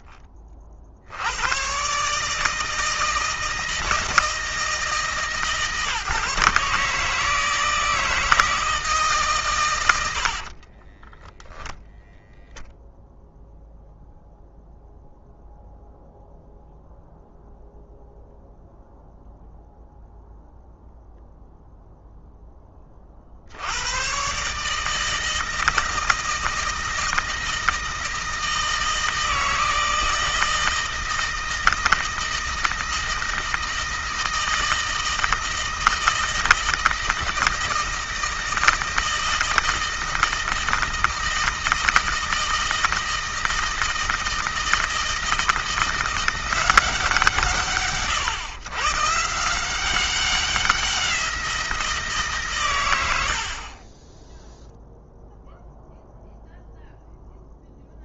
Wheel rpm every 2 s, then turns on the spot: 70, 160, 150, 150, 150, 10, 0, 0, 0, 0, 0, 10, 150, 160, 160, 160, 160, 160, 160, 160, 160, 160, 160, 170, 140, 180, 100, 0, 0.
10-12